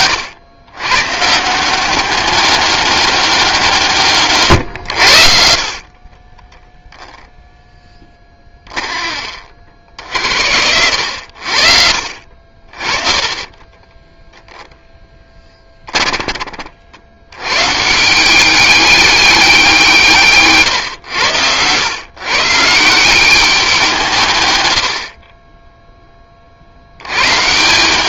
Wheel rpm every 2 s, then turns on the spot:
120, 200, 90, 0, 30, 80, 30, 10, 70, 200, 120, 160, 80, 90.
12-16